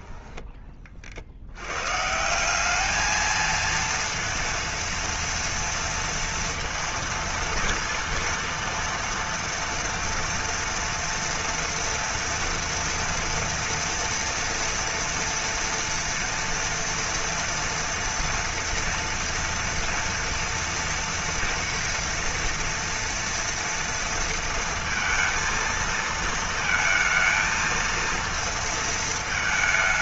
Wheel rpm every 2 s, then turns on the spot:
30, 200, 230, 230, 230, 230, 230, 230, 230, 230, 240, 230, 230, 220, 230.
none